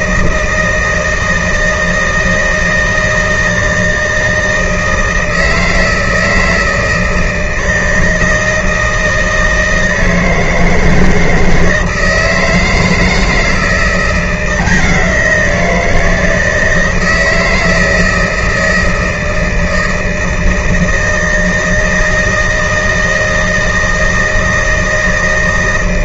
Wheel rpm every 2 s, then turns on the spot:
160, 160, 160, 160, 160, 160, 160, 170, 160, 160, 160, 160, 160.
none